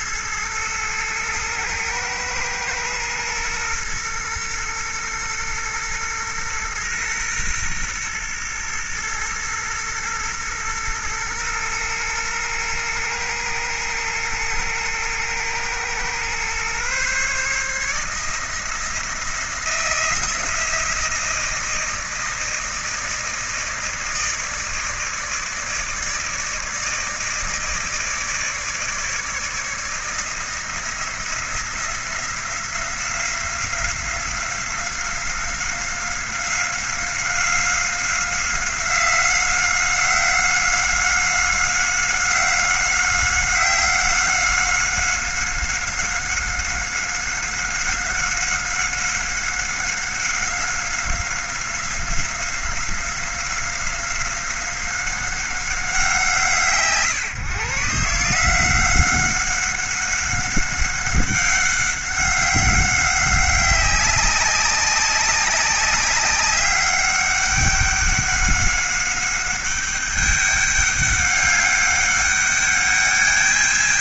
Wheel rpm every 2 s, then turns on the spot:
110, 120, 120, 120, 120, 120, 120, 110, 130, 160, 170, 160, 160, 160, 160, 170, 170, 180, 180, 190, 190, 190, 190, 190, 190, 190, 190, 190, 140, 180, 190, 190, 200, 190, 200, 200, 210.
none